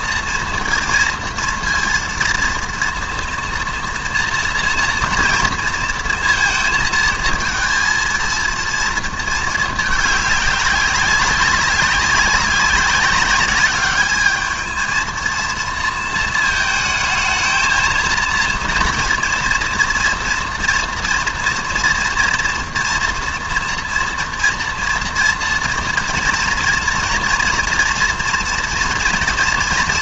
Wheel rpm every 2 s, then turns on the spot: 230, 230, 230, 220, 230, 200, 190, 220, 220, 230, 230, 230, 240, 230, 230.
none